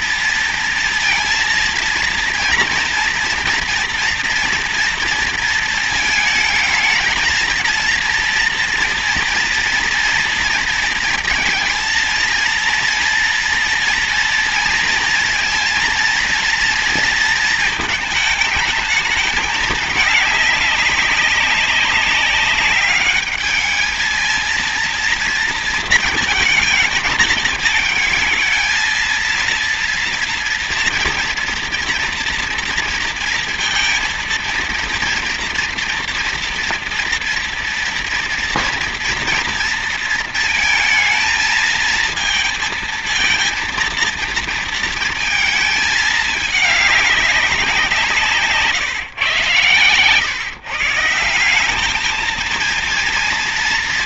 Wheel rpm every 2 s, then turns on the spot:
230, 230, 230, 220, 230, 230, 230, 230, 230, 220, 200, 200, 230, 220, 220, 230, 230, 230, 230, 230, 230, 230, 230, 210, 160, 140, 220.
none